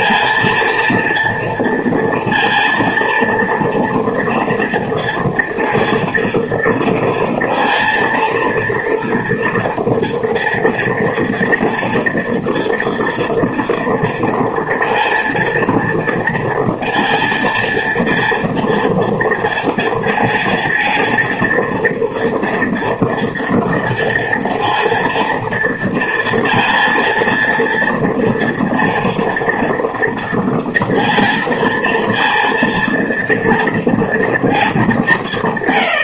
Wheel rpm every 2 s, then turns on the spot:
230, 230, 230, 230, 230, 230, 230, 230, 230, 230, 230, 230, 230, 230, 230, 230, 230, 220.
none